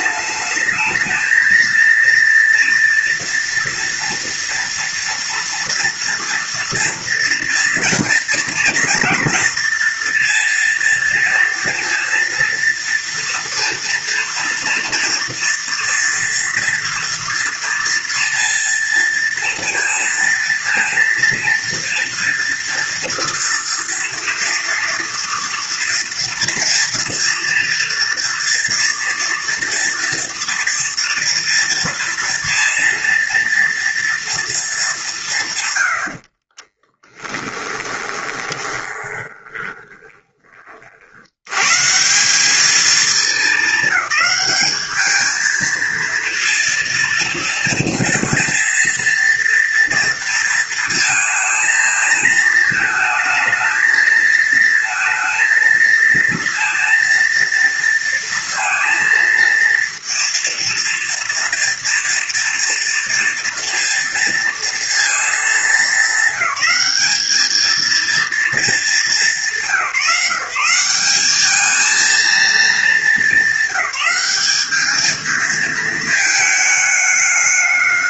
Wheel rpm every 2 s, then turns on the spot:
210, 230, 230, 230, 230, 230, 230, 240, 230, 230, 230, 230, 230, 230, 230, 230, 230, 220, 30, 20, 30, 210, 210, 230, 230, 230, 220, 220, 230, 230, 230, 230, 230, 210, 220, 180, 220, 210, 220.
36-40